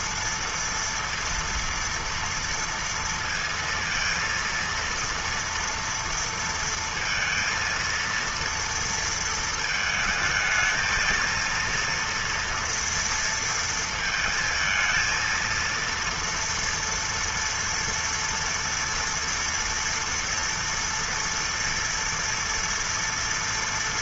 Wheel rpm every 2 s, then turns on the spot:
230, 230, 230, 230, 230, 220, 230, 220, 230, 230, 230, 230.
none